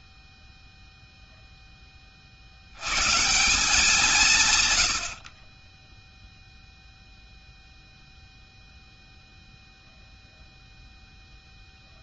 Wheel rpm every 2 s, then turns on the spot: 0, 60, 120, 0, 0, 0.
none